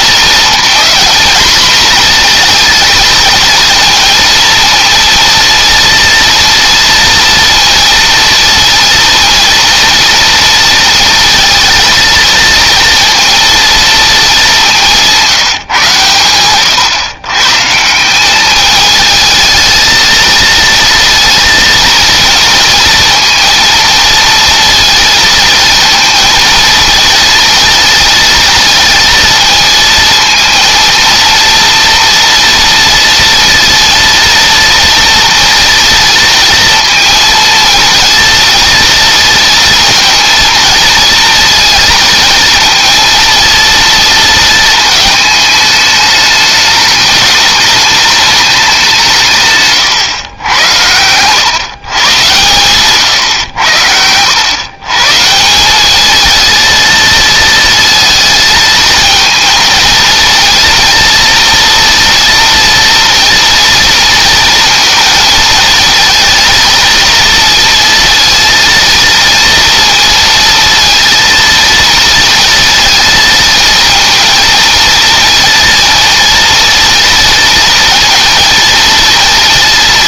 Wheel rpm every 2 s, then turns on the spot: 230, 230, 230, 230, 230, 230, 230, 180, 120, 220, 230, 230, 230, 230, 230, 230, 230, 230, 230, 230, 230, 230, 220, 210, 160, 100, 120, 140, 220, 230, 230, 230, 230, 230, 230, 230, 220, 230, 230, 230.
none